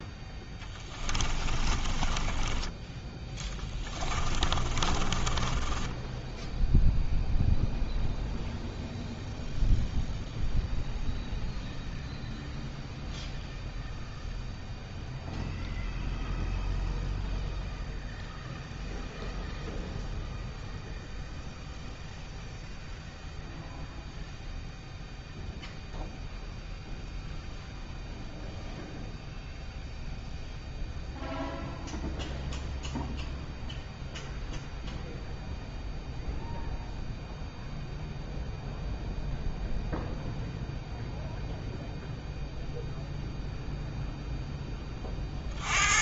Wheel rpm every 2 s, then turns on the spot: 20, 10, 20, 0, 0, 0, 0, 0, 0, 0, 0, 0, 0, 0, 0, 0, 0, 0, 0, 0, 0, 0, 20.
0-2 4-6